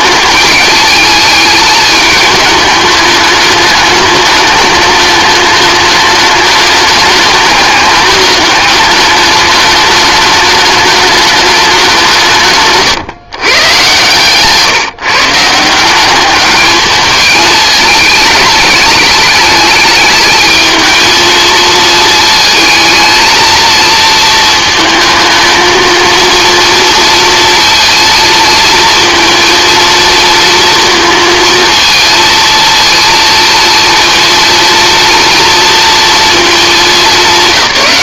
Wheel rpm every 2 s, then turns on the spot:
210, 210, 210, 210, 210, 210, 140, 150, 210, 210, 220, 220, 230, 230, 230, 230, 230, 230, 210.
none